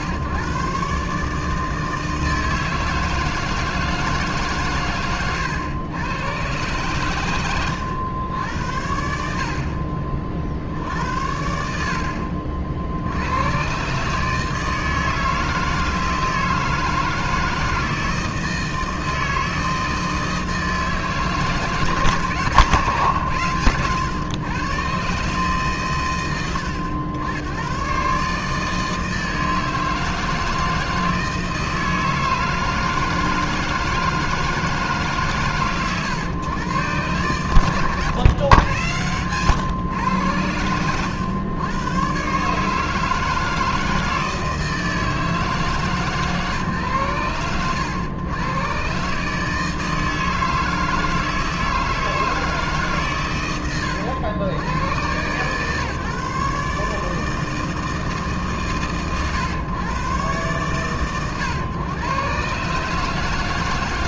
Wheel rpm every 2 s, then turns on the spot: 120, 160, 150, 120, 100, 60, 60, 150, 160, 160, 160, 140, 110, 100, 150, 160, 160, 170, 110, 120, 110, 140, 160, 130, 120, 160, 160, 70, 150, 130, 110, 120.
none